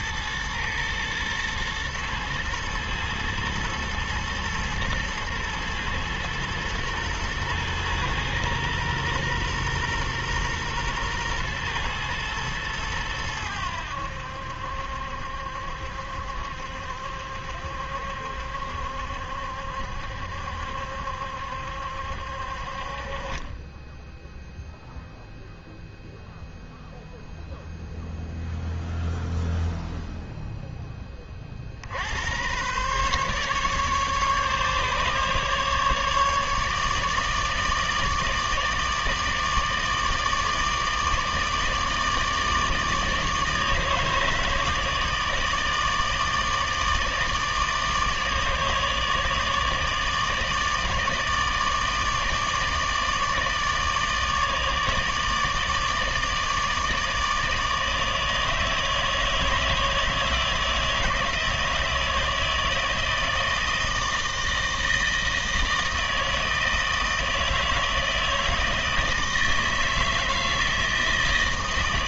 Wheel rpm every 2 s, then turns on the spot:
110, 110, 110, 120, 120, 120, 110, 70, 70, 70, 70, 50, 0, 0, 0, 10, 120, 140, 150, 160, 150, 160, 160, 160, 150, 150, 160, 150, 160, 160, 160, 160, 160, 160, 160, 160.
none